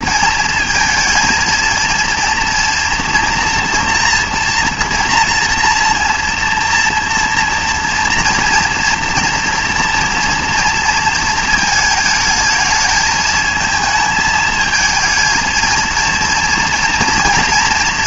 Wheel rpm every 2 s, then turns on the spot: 220, 230, 230, 230, 230, 230, 220, 220, 230.
none